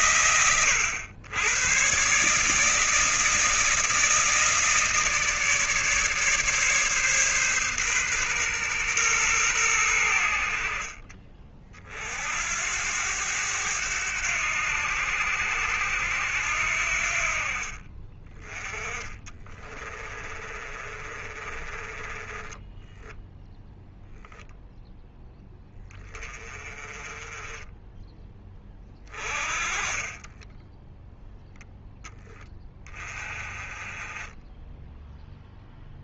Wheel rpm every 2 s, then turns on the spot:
100, 160, 160, 140, 120, 40, 90, 80, 60, 20, 30, 10, 20, 20, 20, 0, 20, 10.
18-22 28-30